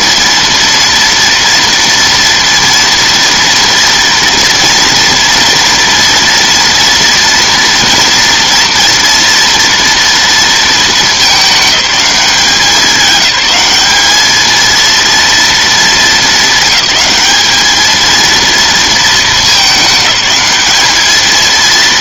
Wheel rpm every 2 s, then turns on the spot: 230, 230, 230, 230, 230, 220, 200, 220, 220, 230, 210.
none